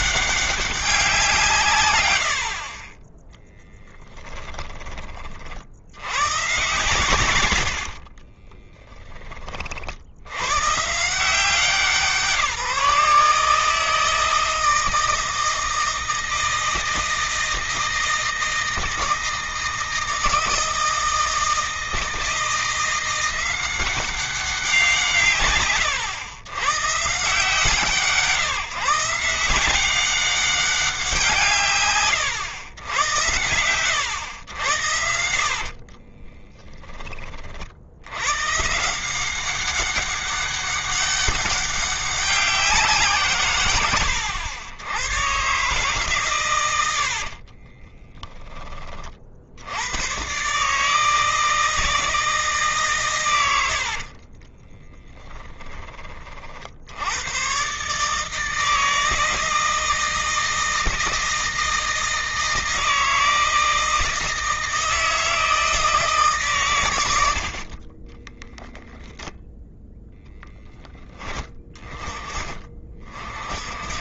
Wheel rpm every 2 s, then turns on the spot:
190, 30, 20, 120, 10, 130, 160, 160, 160, 160, 160, 170, 160, 130, 160, 180, 100, 90, 30, 170, 200, 170, 100, 80, 30, 150, 130, 10, 80, 160, 160, 160, 160, 110, 0, 10, 30.
34-36 46-48 54-56